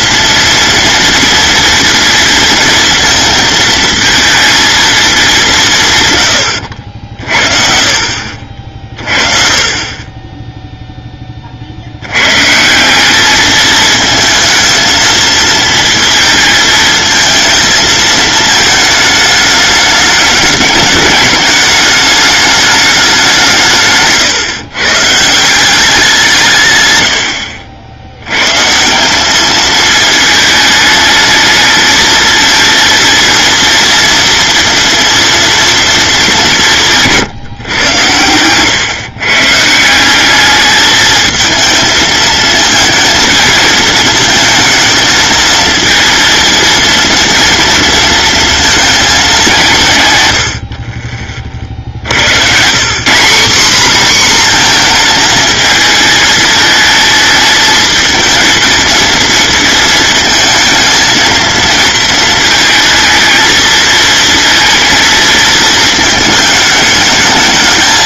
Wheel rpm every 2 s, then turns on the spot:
230, 230, 230, 70, 40, 0, 170, 230, 230, 220, 210, 200, 130, 110, 160, 220, 230, 240, 170, 130, 220, 230, 220, 230, 220, 50, 170, 240, 220, 220, 220, 220, 230, 210.
50-52